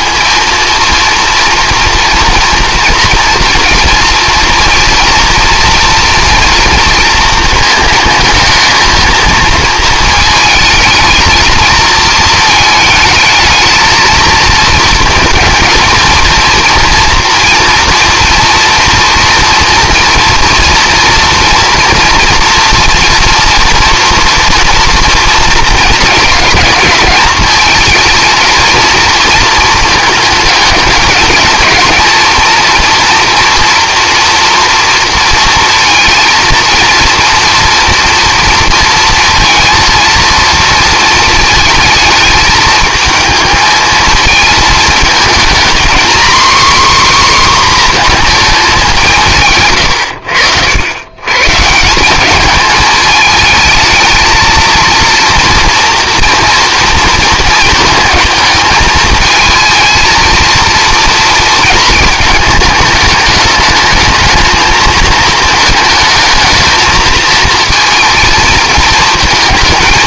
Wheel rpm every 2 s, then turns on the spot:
230, 240, 240, 230, 220, 220, 220, 220, 230, 230, 230, 230, 230, 220, 230, 210, 230, 230, 230, 230, 230, 220, 220, 260, 210, 90, 220, 230, 230, 220, 230, 210, 220, 220, 220.
none